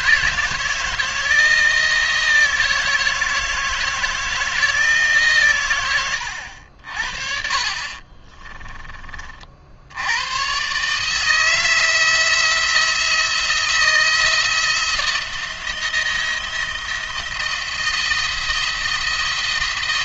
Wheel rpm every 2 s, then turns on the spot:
160, 160, 160, 70, 30, 140, 170, 170, 170, 170.
8-10